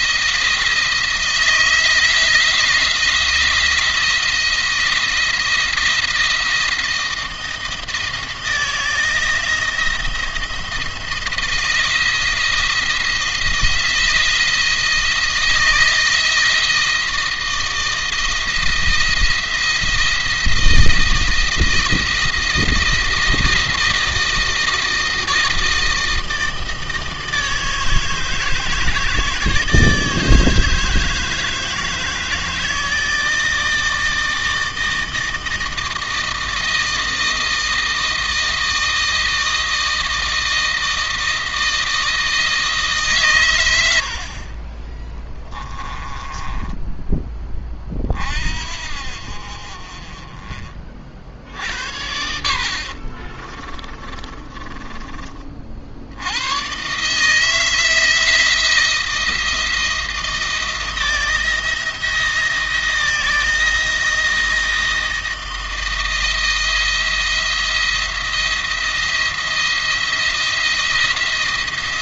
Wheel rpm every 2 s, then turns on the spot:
160, 170, 170, 170, 160, 170, 170, 170, 170, 170, 170, 170, 160, 160, 160, 160, 160, 160, 160, 160, 160, 150, 20, 20, 50, 30, 70, 30, 110, 170, 160, 170, 160, 170, 170, 170.
46-48 52-56